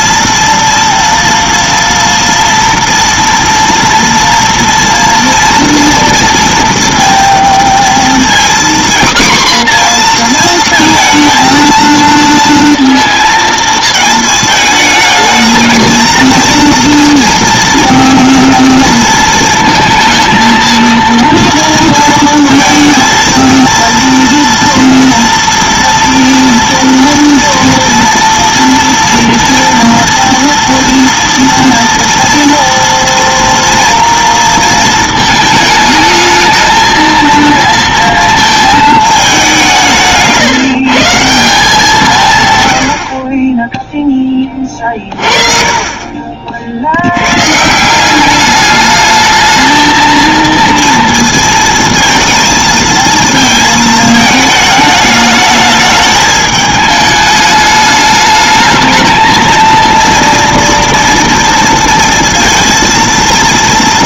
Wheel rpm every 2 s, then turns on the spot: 230, 230, 230, 230, 250, 230, 230, 220, 230, 230, 230, 230, 230, 230, 230, 230, 230, 230, 220, 220, 140, 90, 30, 60, 210, 230, 220, 210, 210, 220, 230, 230.
44-46